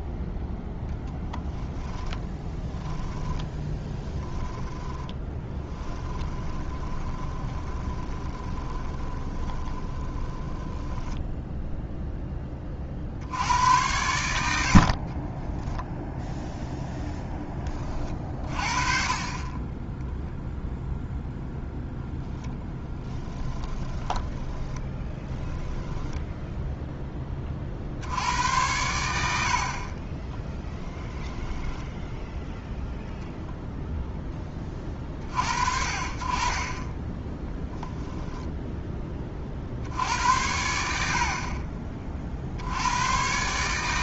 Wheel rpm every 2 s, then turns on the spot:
20, 10, 10, 20, 20, 10, 20, 70, 0, 30, 0, 10, 20, 10, 90, 10, 0, 30, 20, 10, 70, 90.
2-12 22-26